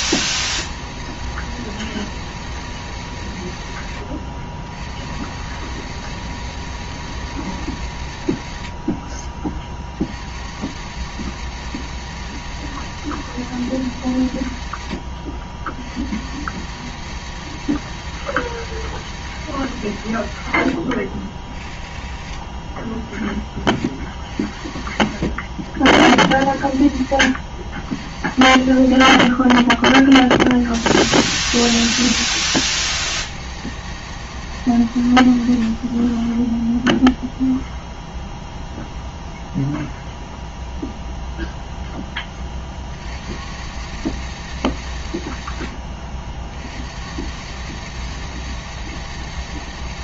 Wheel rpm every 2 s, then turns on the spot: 100, 110, 60, 110, 50, 80, 110, 70, 90, 110, 60, 40, 50, 60, 70, 50, 110, 110, 10, 0, 0, 30, 100, 60, 110.
none